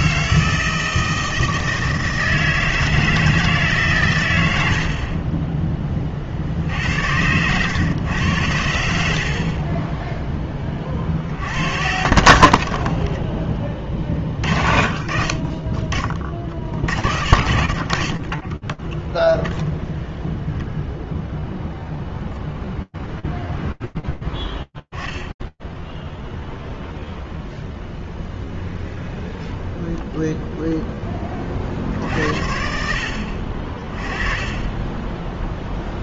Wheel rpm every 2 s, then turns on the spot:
160, 160, 80, 70, 80, 20, 50, 40, 50, 10, 0, 0, 10, 0, 0, 40, 40, 0.
12-14